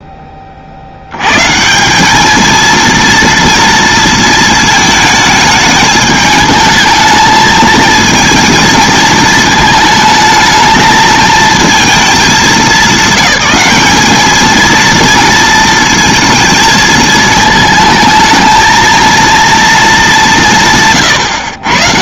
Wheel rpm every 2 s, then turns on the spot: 50, 230, 220, 220, 220, 220, 200, 220, 220, 220, 160.
none